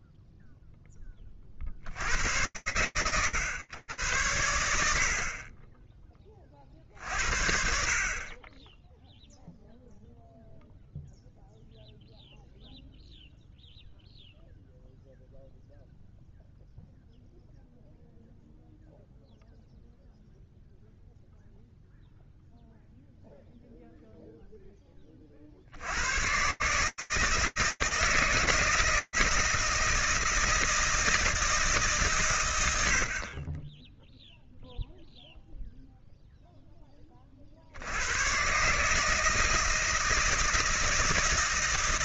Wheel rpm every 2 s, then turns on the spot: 0, 90, 110, 40, 30, 0, 0, 0, 0, 0, 0, 0, 20, 150, 160, 160, 80, 0, 30, 150, 160.
none